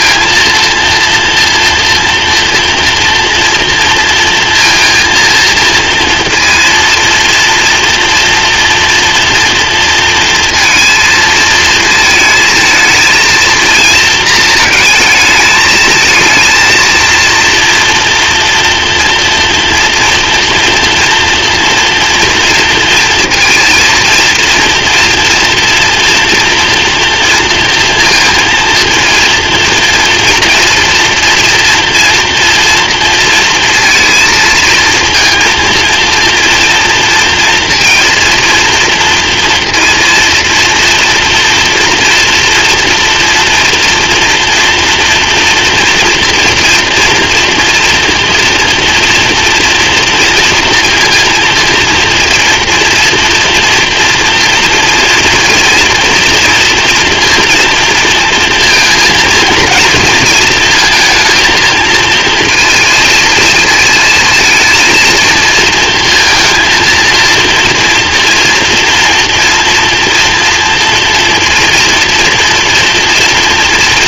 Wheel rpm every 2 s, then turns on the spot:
230, 230, 230, 230, 230, 230, 230, 220, 220, 230, 240, 230, 230, 230, 230, 230, 230, 230, 230, 230, 230, 230, 240, 230, 230, 230, 230, 230, 230, 230, 220, 220, 230, 230, 230, 230, 230.
none